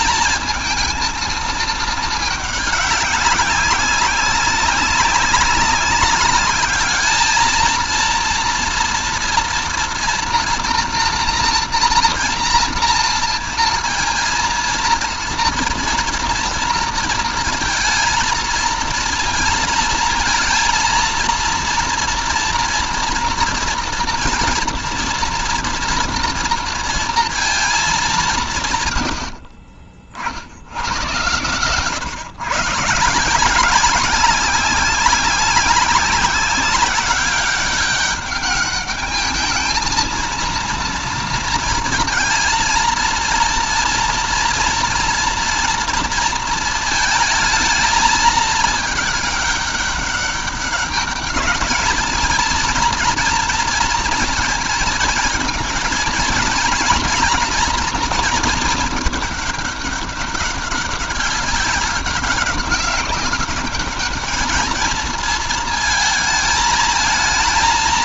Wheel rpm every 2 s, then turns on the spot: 220, 200, 190, 230, 230, 240, 230, 230, 230, 230, 230, 230, 240, 220, 60, 110, 170, 190, 200, 220, 230, 230, 230, 220, 210, 200, 230, 220, 230, 210, 200, 200, 230, 230.
none